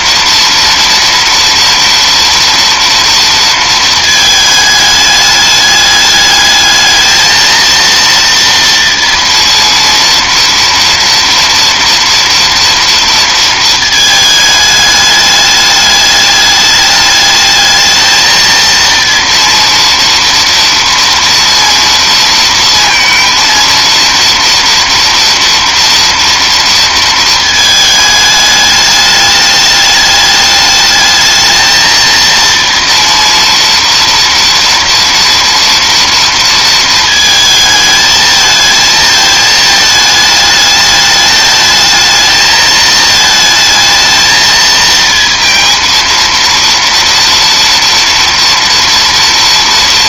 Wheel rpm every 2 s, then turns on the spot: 230, 230, 210, 220, 230, 230, 230, 210, 210, 230, 230, 230, 230, 230, 210, 210, 230, 240, 230, 220, 210, 220, 220, 230, 230.
none